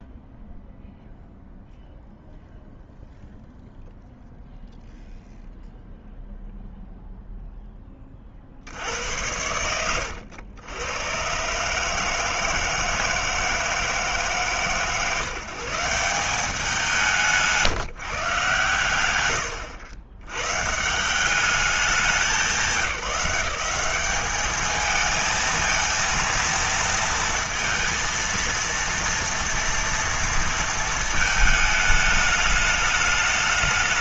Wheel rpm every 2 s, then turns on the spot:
0, 0, 0, 0, 90, 110, 160, 150, 170, 110, 150, 180, 220, 230, 230, 220, 210.
none